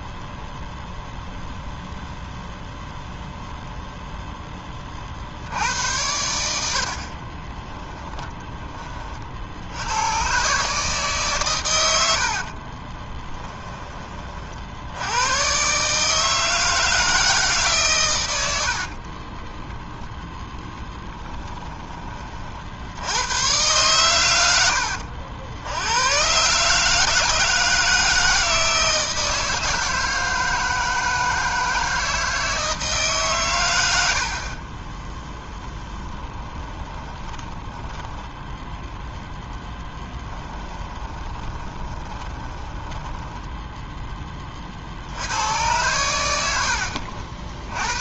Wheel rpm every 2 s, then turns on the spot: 0, 0, 30, 60, 30, 150, 30, 90, 160, 40, 10, 80, 80, 150, 160, 160, 150, 20, 20, 10, 20, 10, 60, 60.
6-8 12-14 18-22 36-44